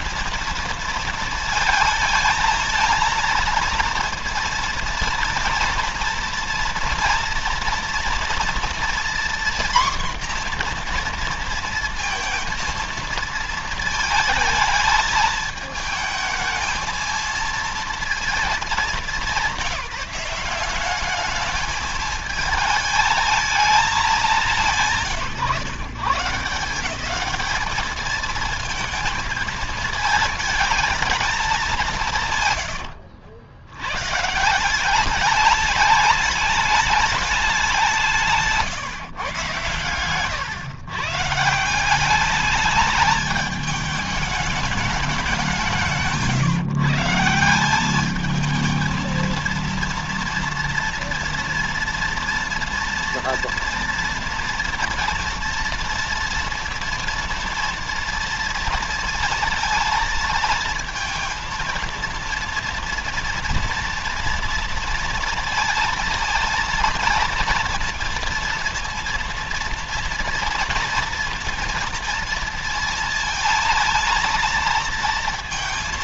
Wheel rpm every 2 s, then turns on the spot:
230, 230, 230, 230, 230, 240, 230, 220, 230, 220, 190, 220, 180, 160, 230, 220, 130, 160, 200, 150, 120, 210, 210, 130, 220, 240, 230, 230, 230, 230, 220, 230, 230, 230, 230, 230, 230, 230.
32-34